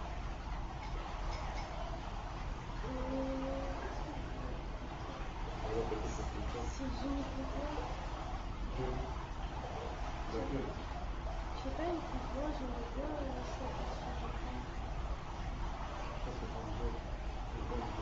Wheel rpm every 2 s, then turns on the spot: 0, 0, 0, 0, 0, 0, 0, 0, 0.
none